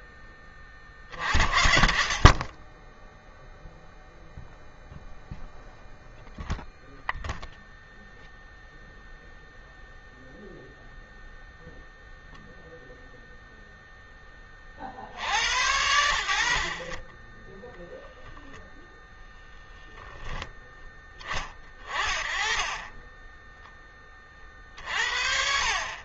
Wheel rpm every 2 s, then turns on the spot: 10, 30, 0, 0, 0, 0, 0, 30, 50, 0, 10, 20, 50.
none